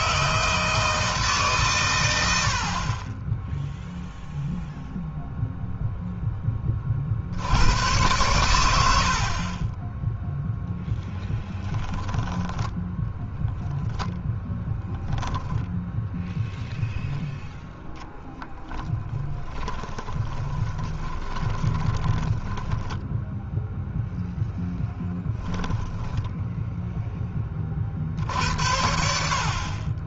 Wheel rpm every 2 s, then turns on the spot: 160, 50, 0, 30, 90, 10, 10, 10, 0, 30, 20, 10, 0, 0, 60.
18-24